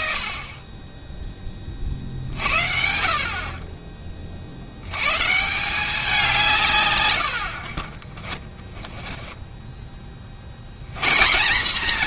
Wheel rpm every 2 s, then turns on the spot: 30, 60, 80, 130, 10, 110.
0-2 8-10